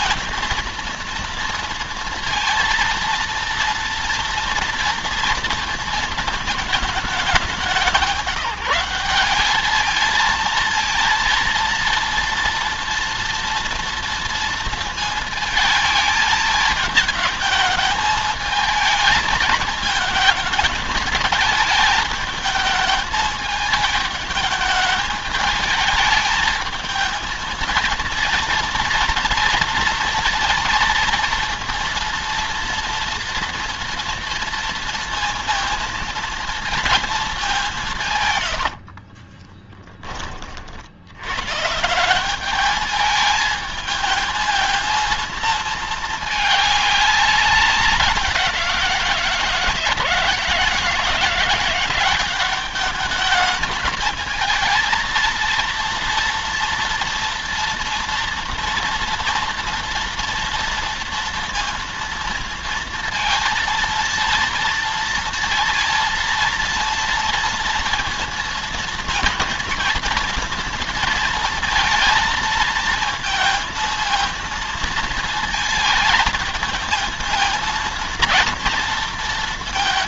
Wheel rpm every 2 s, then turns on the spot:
230, 230, 230, 210, 180, 230, 230, 230, 220, 220, 220, 220, 210, 220, 230, 230, 230, 230, 220, 60, 70, 210, 220, 210, 170, 170, 210, 230, 230, 240, 230, 230, 230, 230, 230, 230, 220, 230, 220, 230.
38-40